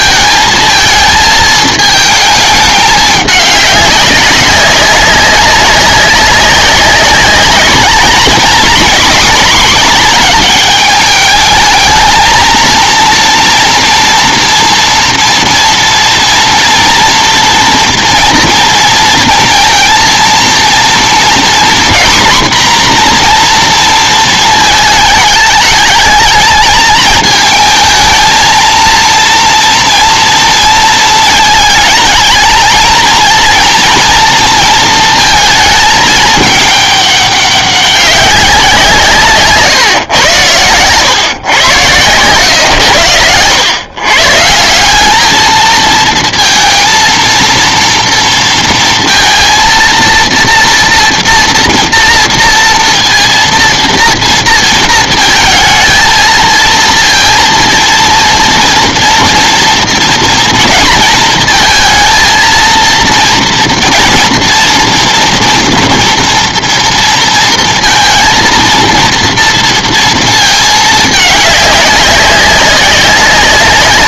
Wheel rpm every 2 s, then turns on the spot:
220, 210, 200, 200, 230, 210, 230, 230, 230, 230, 230, 250, 220, 220, 230, 230, 220, 230, 210, 180, 110, 110, 160, 230, 230, 230, 230, 230, 220, 230, 230, 230, 230, 230, 230, 220, 200.
none